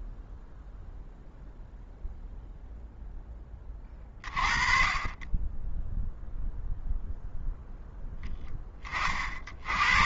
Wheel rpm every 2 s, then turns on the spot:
0, 30, 20, 10, 110.
none